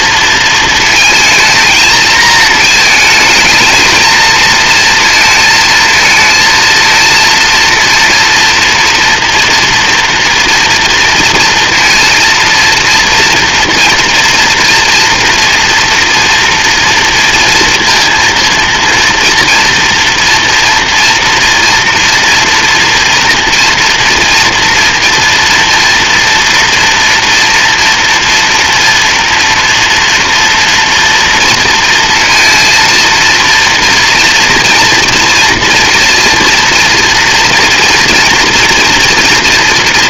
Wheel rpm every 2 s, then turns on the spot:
230, 220, 230, 230, 230, 230, 230, 230, 230, 230, 230, 240, 230, 230, 240, 230, 230, 230, 230, 240.
none